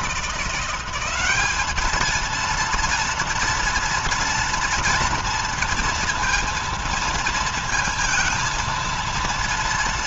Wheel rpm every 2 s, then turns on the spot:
180, 230, 230, 230, 230.
none